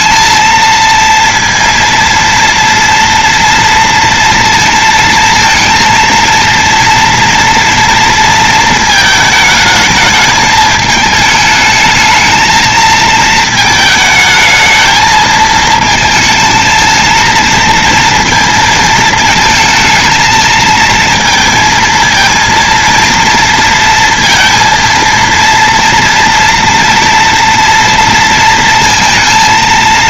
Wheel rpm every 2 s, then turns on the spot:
230, 230, 230, 230, 220, 220, 220, 220, 230, 220, 220, 230, 230, 230, 230.
none